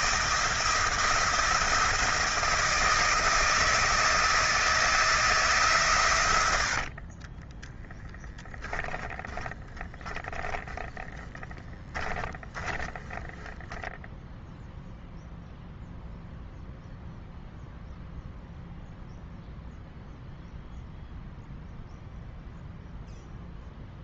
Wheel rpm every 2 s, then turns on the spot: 170, 160, 160, 80, 10, 10, 10, 0, 0, 0, 0, 0.
6-14